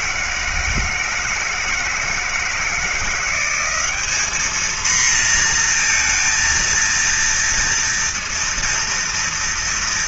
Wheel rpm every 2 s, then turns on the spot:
160, 170, 230, 230, 230.
none